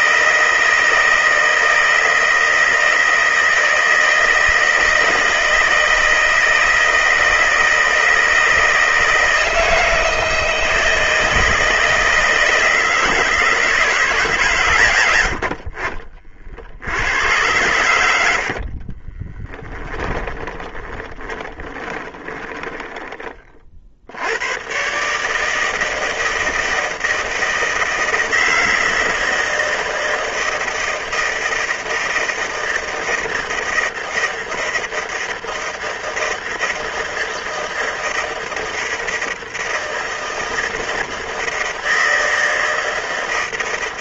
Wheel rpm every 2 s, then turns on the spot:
160, 160, 160, 160, 160, 160, 160, 110, 70, 50, 20, 20, 120, 160, 160, 160, 160, 160, 160, 160, 160, 160.
18-22